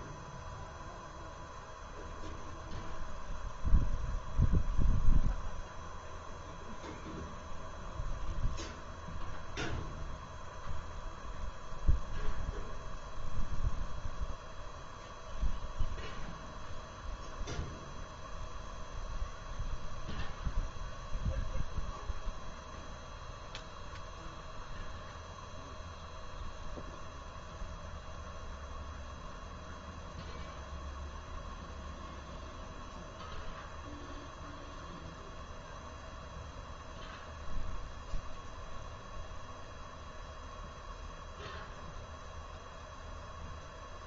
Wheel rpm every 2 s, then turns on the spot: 0, 0, 0, 0, 0, 0, 0, 0, 0, 0, 0, 0, 0, 0, 0, 0, 0, 0, 0, 0, 0, 0.
none